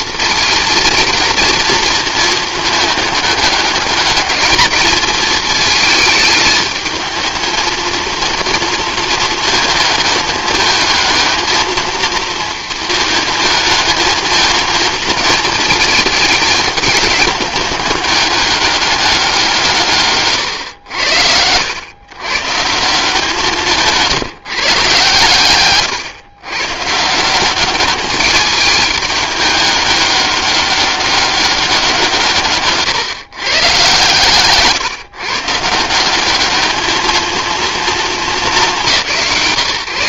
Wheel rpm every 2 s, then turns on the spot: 230, 220, 220, 220, 230, 220, 230, 220, 210, 200, 110, 150, 150, 130, 210, 200, 140, 140, 210, 200.
34-36